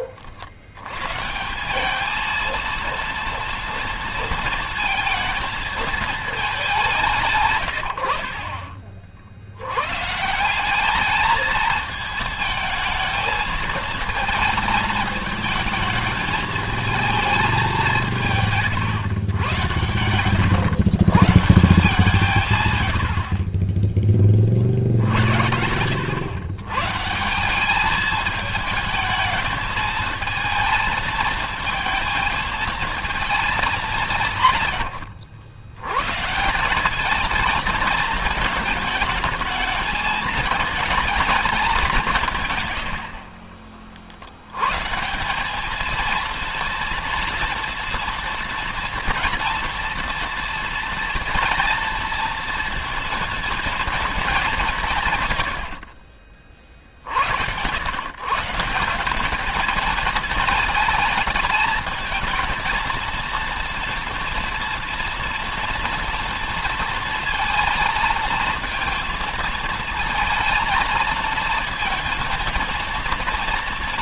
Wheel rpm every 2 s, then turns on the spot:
80, 230, 230, 200, 40, 180, 220, 220, 220, 150, 100, 130, 40, 120, 220, 220, 220, 130, 190, 220, 220, 140, 110, 230, 230, 230, 230, 200, 50, 160, 220, 230, 230, 230, 230, 230, 230.
none